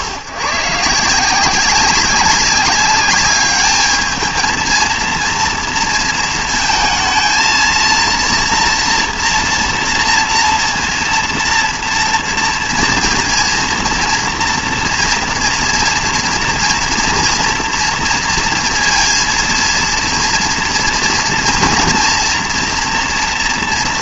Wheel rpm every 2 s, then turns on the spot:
120, 200, 220, 230, 230, 230, 230, 230, 230, 230, 240, 230.
none